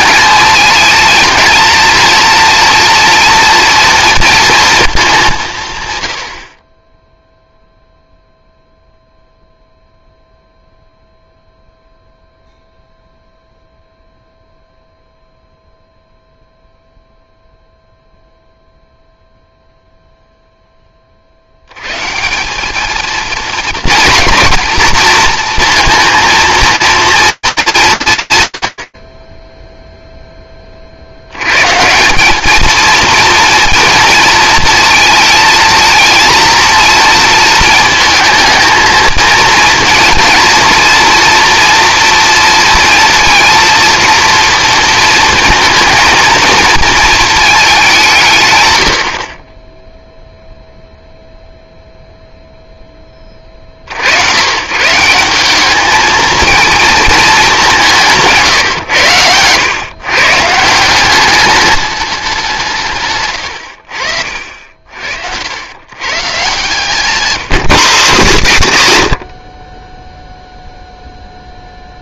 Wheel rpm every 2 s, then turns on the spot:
220, 230, 220, 30, 0, 0, 0, 0, 0, 0, 10, 200, 240, 230, 120, 0, 180, 220, 230, 220, 230, 230, 230, 230, 170, 0, 0, 120, 220, 120, 160, 180, 60, 160, 130, 0.
none